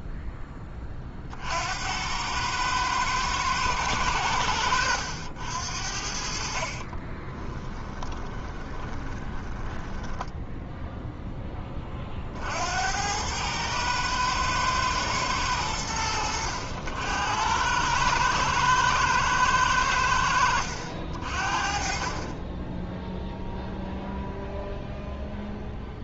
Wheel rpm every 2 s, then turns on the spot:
40, 110, 90, 40, 20, 0, 90, 110, 80, 110, 60, 10, 0.
6-10